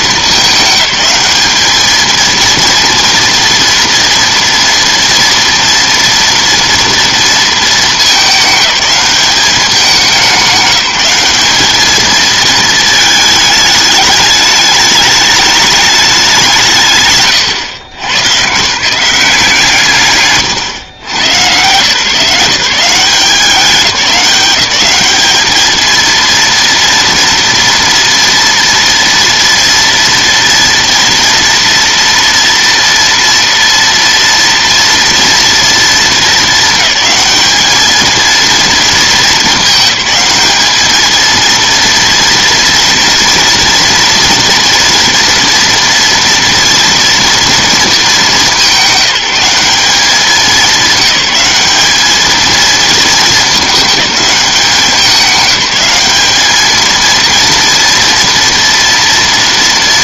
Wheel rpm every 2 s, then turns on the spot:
210, 230, 230, 230, 210, 190, 220, 210, 180, 140, 120, 170, 200, 230, 230, 230, 230, 230, 220, 230, 220, 230, 230, 230, 200, 200, 220, 200, 220, 230.
none